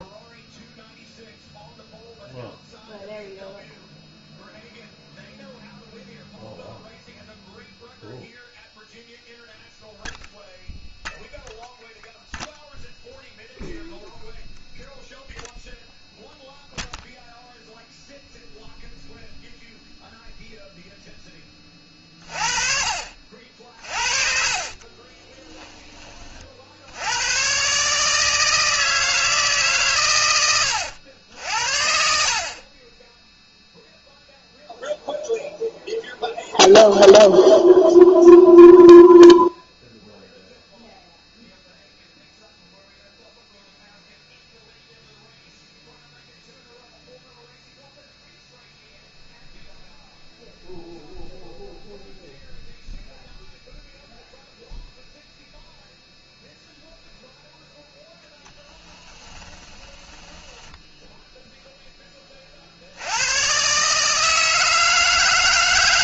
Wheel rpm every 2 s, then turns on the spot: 0, 0, 0, 0, 0, 0, 0, 0, 0, 0, 0, 40, 40, 60, 160, 100, 30, 0, 0, 0, 0, 0, 0, 0, 0, 0, 0, 0, 0, 10, 10, 60, 160.
24-26 60-62